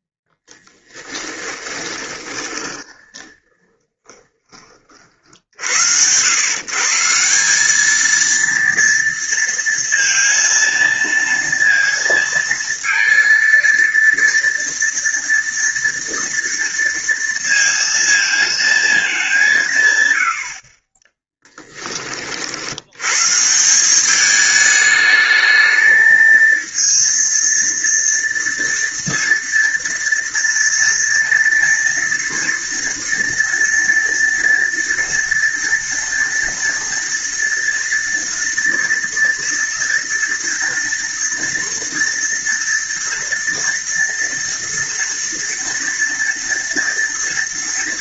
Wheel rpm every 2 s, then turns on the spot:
10, 20, 50, 170, 230, 230, 230, 230, 230, 210, 20, 110, 220, 230, 230, 230, 230, 230, 230, 230, 230, 230, 230, 230.
0-4 20-22